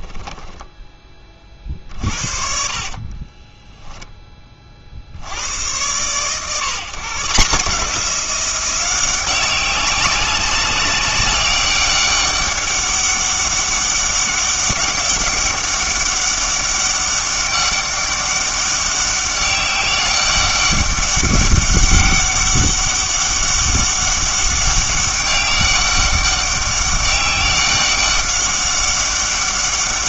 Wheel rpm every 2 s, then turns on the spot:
10, 40, 30, 130, 180, 200, 200, 190, 200, 200, 200, 200, 200, 200, 200.
0-2